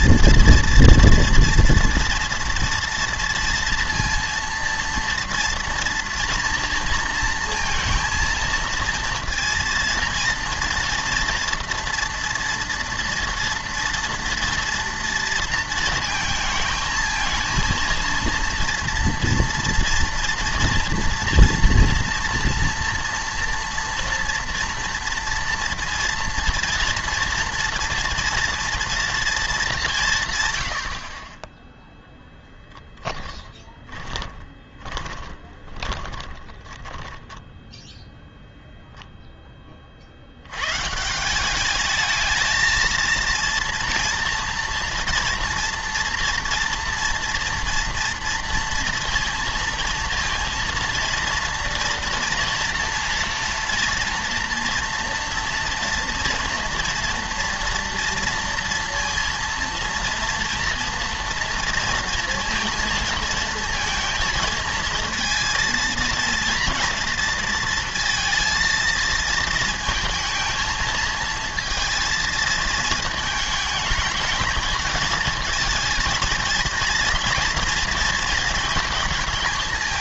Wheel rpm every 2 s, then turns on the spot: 230, 230, 230, 230, 230, 230, 230, 230, 220, 230, 230, 230, 240, 230, 240, 90, 10, 20, 10, 0, 120, 230, 240, 230, 230, 230, 230, 240, 230, 230, 230, 230, 220, 230, 220, 220, 220, 220, 230, 220.
32-38